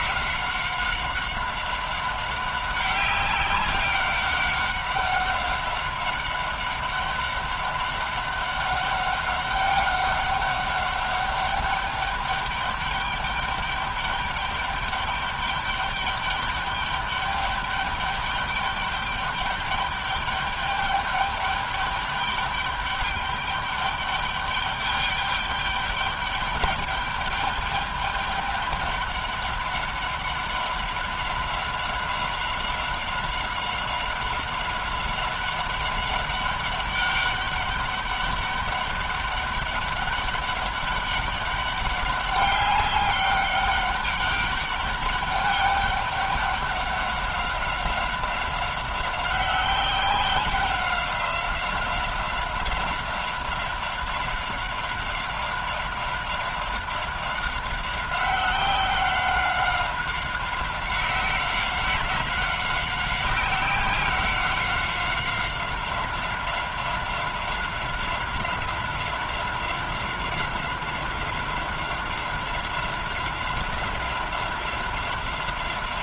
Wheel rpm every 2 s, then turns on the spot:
190, 190, 200, 190, 200, 200, 200, 200, 200, 210, 200, 200, 210, 210, 200, 200, 190, 190, 200, 200, 200, 200, 200, 200, 190, 190, 190, 190, 190, 190, 190, 190, 190, 190, 190, 190, 190, 190.
none